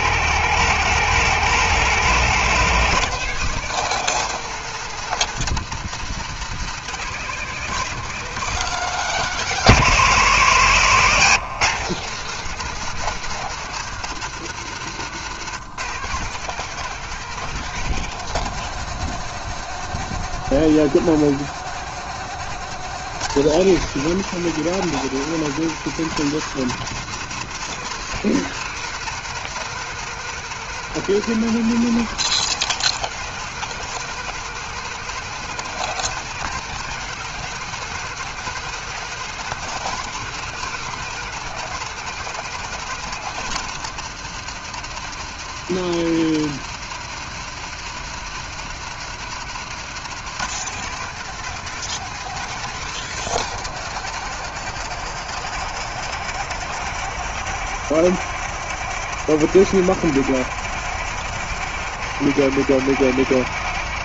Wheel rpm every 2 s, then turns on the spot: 150, 170, 170, 150, 160, 140, 170, 150, 180, 170, 170, 170, 180, 170, 180, 180, 180, 180, 180, 180, 180, 170, 160, 160, 160, 170, 170, 160, 170, 160, 160, 160.
14-16